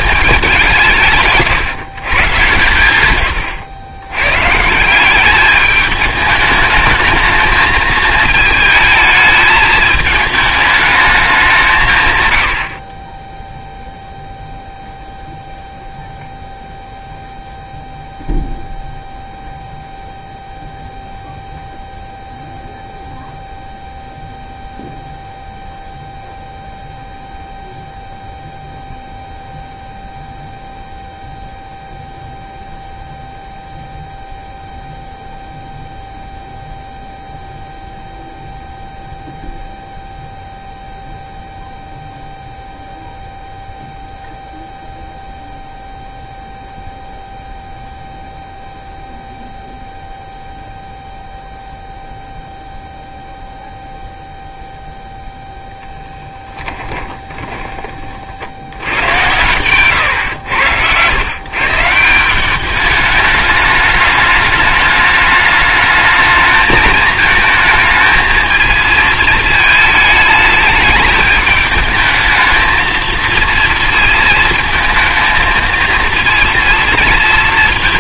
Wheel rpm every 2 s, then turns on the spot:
190, 110, 150, 220, 220, 220, 80, 0, 0, 0, 0, 0, 0, 0, 0, 0, 0, 0, 0, 0, 0, 0, 0, 0, 0, 0, 0, 0, 20, 80, 110, 190, 210, 220, 220, 210, 220, 220, 230.
56-58 60-62